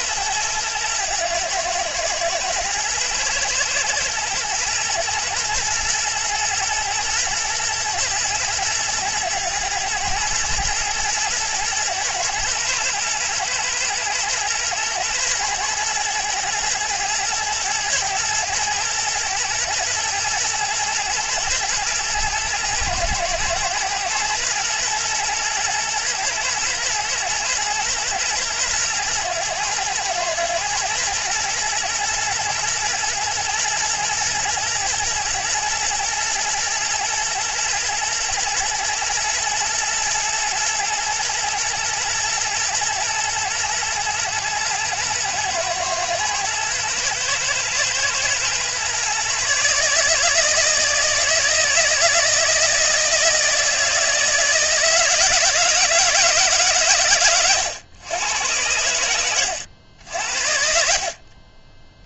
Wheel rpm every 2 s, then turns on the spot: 110, 120, 110, 110, 110, 110, 110, 120, 110, 110, 110, 110, 120, 120, 110, 110, 120, 110, 110, 110, 110, 110, 120, 110, 130, 160, 160, 160, 130, 90, 50.
60-62